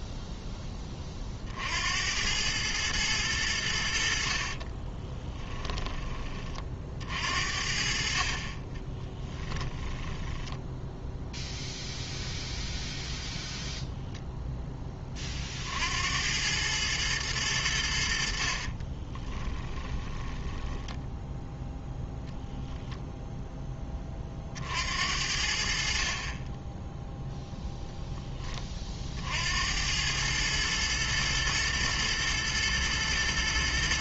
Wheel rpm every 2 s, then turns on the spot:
10, 100, 50, 40, 40, 10, 0, 10, 100, 50, 10, 0, 40, 20, 20, 110, 110.
4-6 8-12 18-22